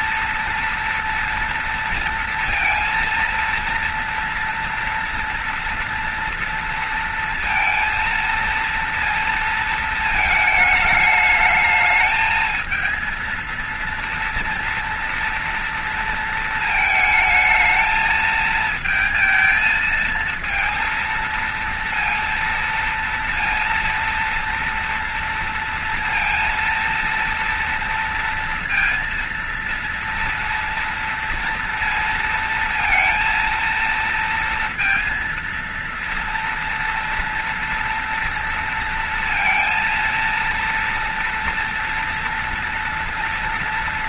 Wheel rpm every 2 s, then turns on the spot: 230, 230, 230, 230, 230, 220, 220, 240, 230, 220, 230, 230, 230, 230, 230, 230, 230, 230, 230, 230, 230, 230.
none